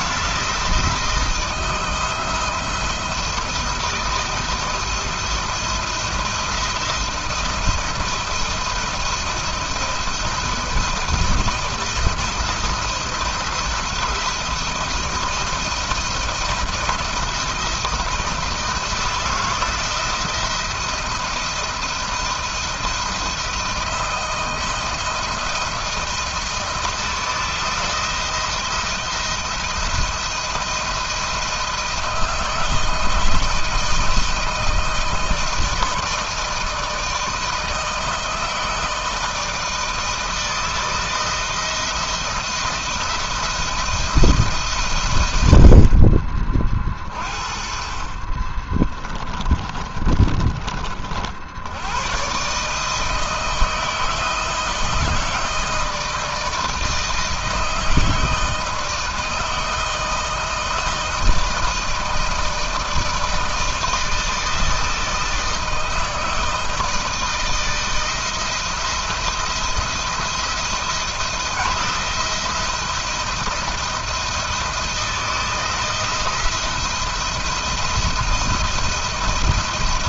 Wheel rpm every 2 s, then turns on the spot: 160, 170, 170, 170, 170, 170, 170, 170, 170, 170, 170, 170, 170, 160, 170, 160, 160, 160, 160, 160, 160, 170, 100, 40, 20, 50, 150, 160, 160, 160, 160, 160, 160, 160, 170, 160, 170, 160, 170, 170.
48-50